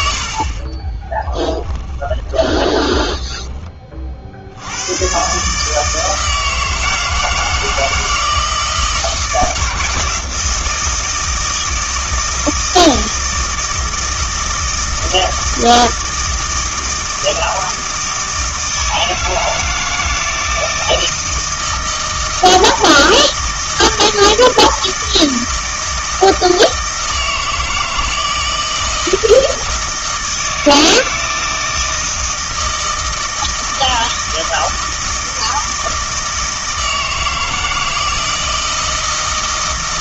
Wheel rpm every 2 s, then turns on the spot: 40, 20, 90, 160, 160, 160, 170, 160, 160, 160, 160, 160, 160, 160, 160, 160, 160, 160, 160, 160.
0-4